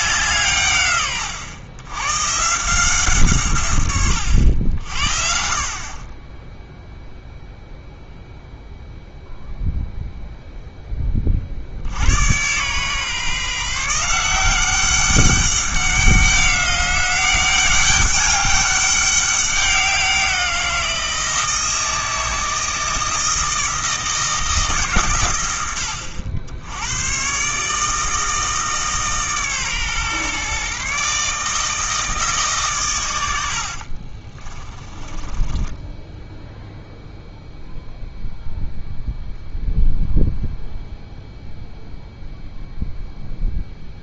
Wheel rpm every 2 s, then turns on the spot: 140, 150, 80, 10, 0, 0, 120, 190, 190, 200, 170, 160, 150, 80, 150, 140, 140, 20, 0, 0, 0, 0.
34-36